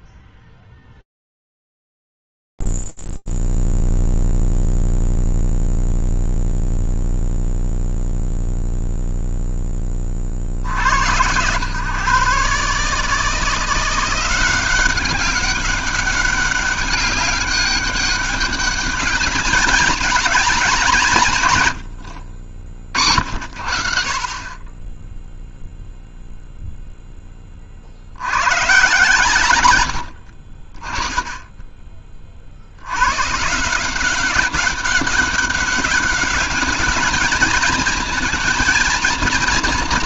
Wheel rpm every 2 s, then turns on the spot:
0, 0, 0, 0, 0, 60, 130, 180, 200, 200, 210, 80, 30, 0, 120, 40, 80, 200, 200, 230.
none